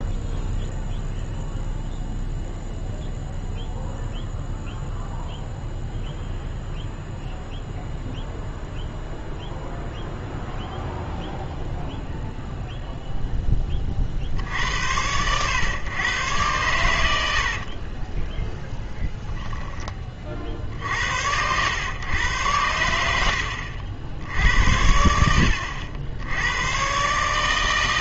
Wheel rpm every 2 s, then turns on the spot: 0, 0, 0, 0, 0, 0, 0, 80, 110, 0, 60, 100, 80, 110.
none